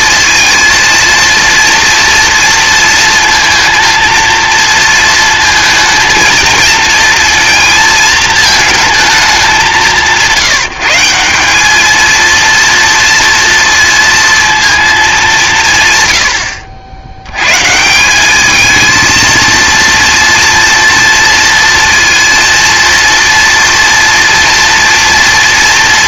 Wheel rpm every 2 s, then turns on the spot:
230, 230, 230, 230, 220, 170, 230, 230, 70, 220, 230, 230, 230.
none